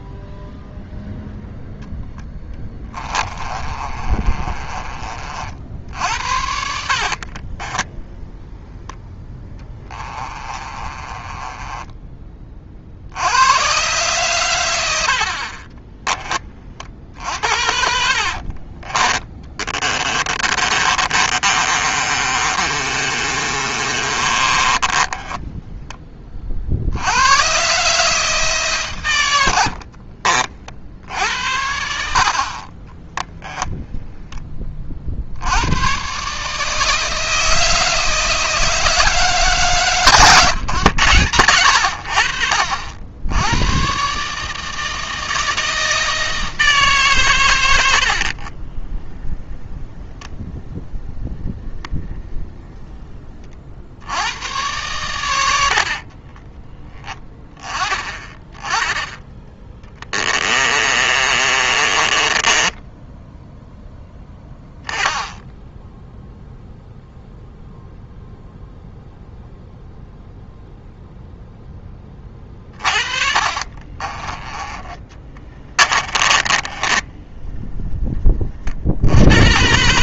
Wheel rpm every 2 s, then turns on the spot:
0, 20, 40, 60, 10, 30, 60, 90, 50, 20, 30, 30, 20, 80, 130, 60, 30, 50, 160, 160, 110, 70, 160, 140, 20, 20, 20, 100, 10, 20, 30, 10, 10, 0, 0, 0, 40, 20, 20, 70.
2-4 6-8 10-12 16-26 32-34 48-50 60-64 72-78